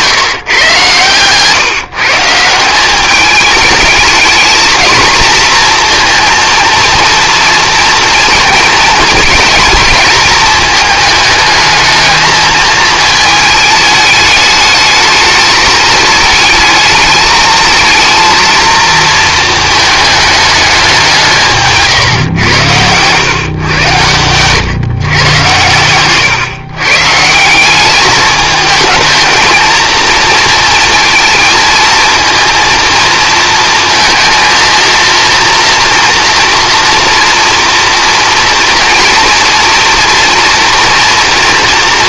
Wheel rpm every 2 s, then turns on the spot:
130, 180, 230, 230, 240, 220, 220, 220, 220, 230, 200, 100, 130, 130, 220, 230, 230, 230, 230, 230, 230.
22-24